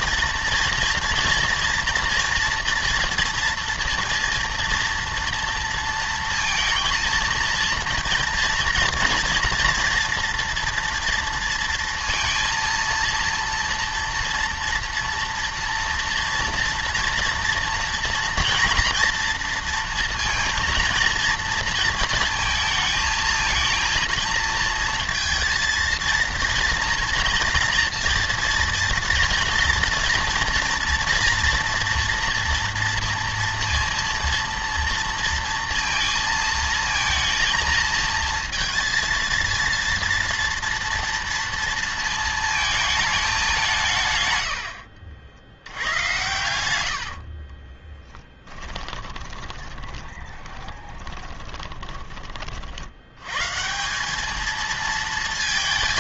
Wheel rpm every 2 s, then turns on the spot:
230, 240, 230, 230, 230, 230, 230, 230, 230, 240, 230, 230, 230, 230, 230, 230, 230, 230, 230, 230, 230, 220, 90, 100, 20, 20, 60, 220.
46-52